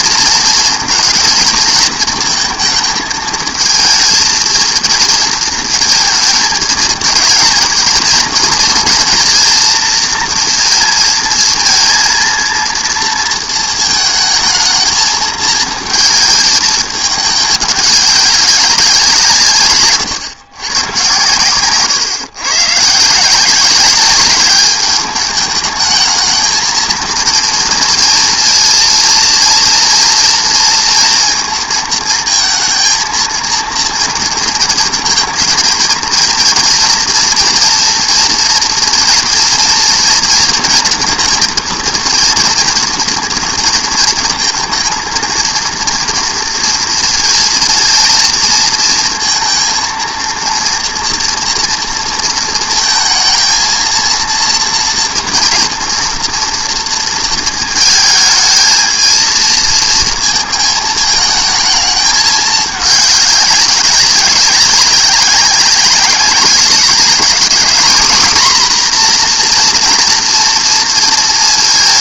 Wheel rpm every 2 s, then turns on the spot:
230, 230, 230, 220, 230, 230, 230, 210, 220, 190, 120, 140, 210, 220, 230, 230, 220, 230, 240, 230, 230, 240, 230, 230, 230, 230, 230, 230, 240, 220, 220, 210, 200, 200, 240, 230.
none